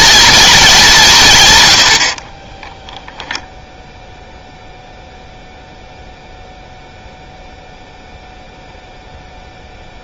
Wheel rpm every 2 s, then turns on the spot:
220, 10, 0, 0, 0.
2-4